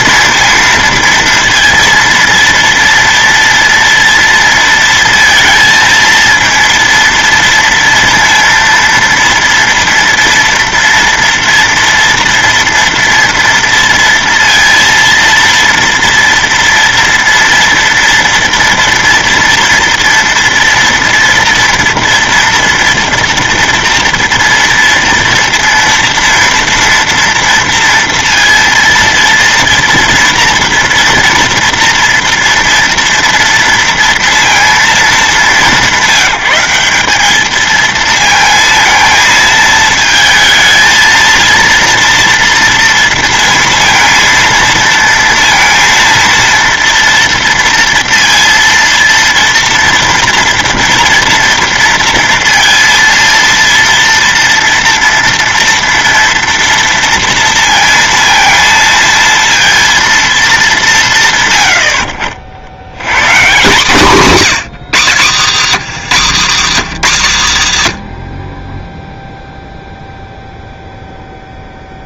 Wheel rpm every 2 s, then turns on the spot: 230, 230, 230, 230, 230, 230, 230, 230, 230, 230, 230, 230, 230, 230, 230, 230, 230, 230, 200, 230, 220, 230, 230, 230, 230, 230, 230, 230, 230, 230, 200, 70, 180, 230, 50, 0.
68-70